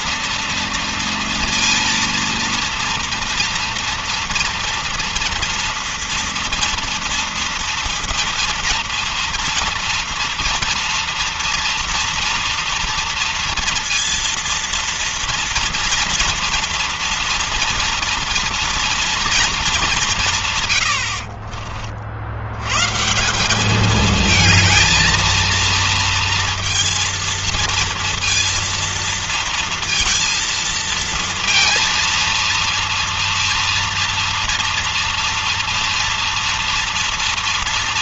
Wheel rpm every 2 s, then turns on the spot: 230, 230, 230, 230, 230, 240, 230, 230, 230, 230, 170, 80, 220, 230, 230, 230, 230, 230, 230.
none